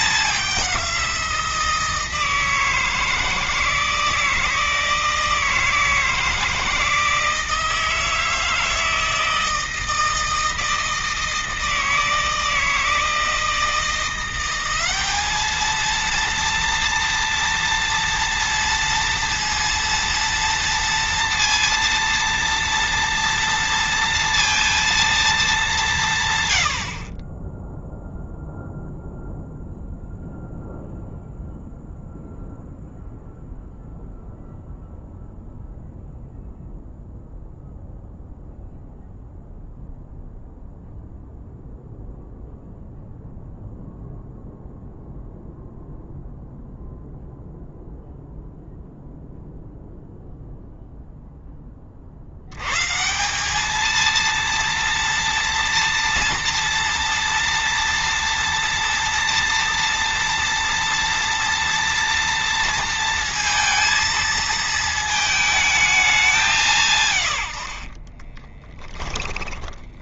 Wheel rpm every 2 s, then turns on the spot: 190, 160, 160, 160, 160, 160, 160, 180, 230, 230, 230, 230, 230, 100, 0, 0, 0, 0, 0, 0, 0, 0, 0, 0, 0, 0, 100, 230, 230, 230, 230, 230, 230, 180, 20.
68-70